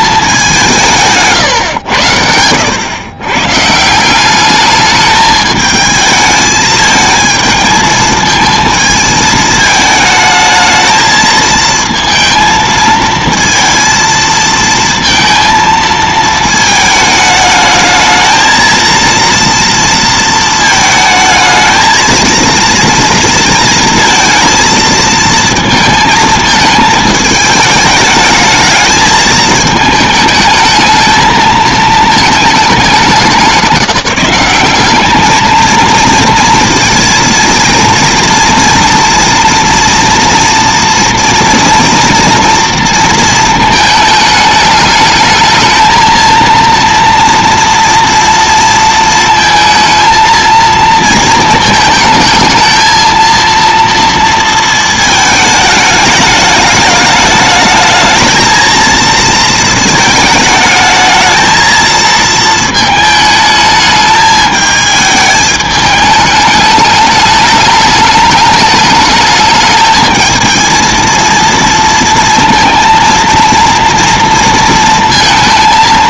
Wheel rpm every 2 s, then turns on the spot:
190, 90, 200, 220, 220, 220, 230, 230, 220, 230, 220, 230, 230, 220, 210, 220, 210, 200, 230, 240, 230, 230, 220, 230, 230, 230, 220, 220, 210, 230, 220, 220, 220, 210, 210, 220, 230, 230.
none